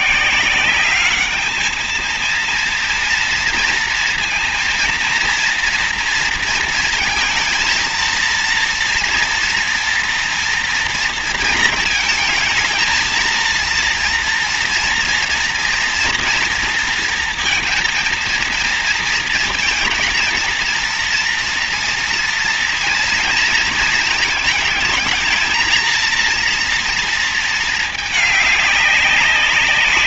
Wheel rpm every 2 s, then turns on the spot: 160, 230, 230, 230, 230, 240, 220, 230, 230, 230, 230, 230, 220, 230, 210.
none